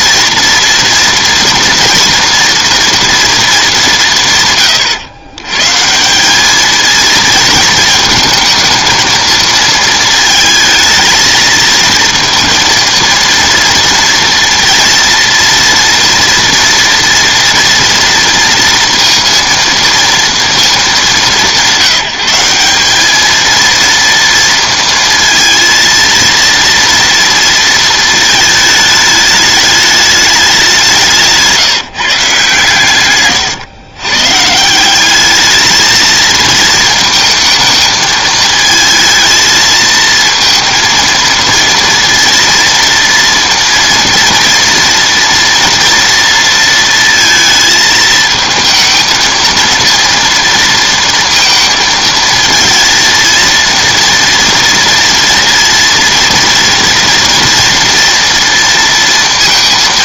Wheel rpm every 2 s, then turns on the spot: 230, 230, 100, 220, 220, 220, 230, 230, 230, 230, 210, 210, 230, 230, 210, 170, 130, 190, 220, 220, 230, 230, 230, 230, 220, 230, 230, 230, 240, 230.
none